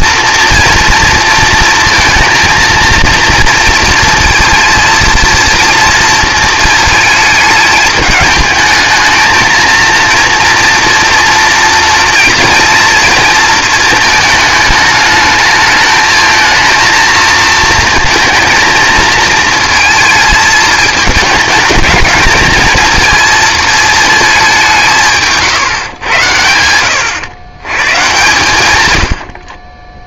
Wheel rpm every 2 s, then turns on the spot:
230, 230, 230, 220, 220, 230, 230, 220, 230, 220, 220, 220, 180, 80, 110.
none